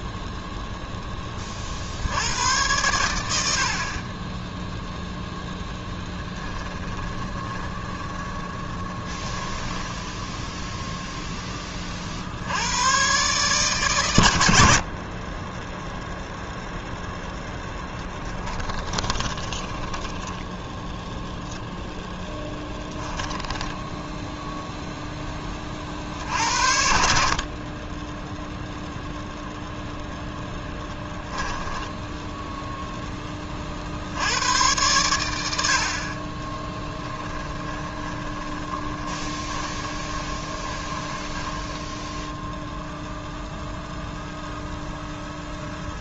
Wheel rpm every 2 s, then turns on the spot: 0, 110, 10, 20, 20, 10, 100, 70, 0, 20, 10, 10, 0, 50, 0, 10, 0, 100, 30, 30, 20, 0, 0.
6-10 18-24 30-32 36-42